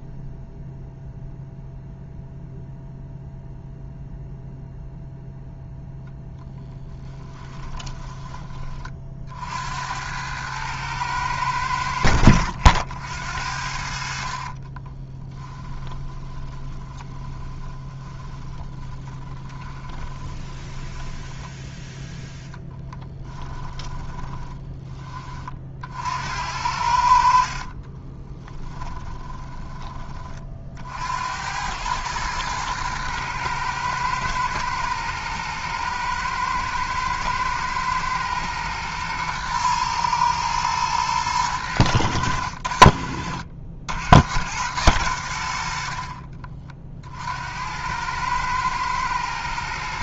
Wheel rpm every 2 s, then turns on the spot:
0, 0, 0, 10, 30, 110, 70, 20, 20, 20, 10, 10, 20, 70, 20, 60, 110, 120, 110, 120, 110, 60, 100, 50, 110.
6-8 14-24 28-30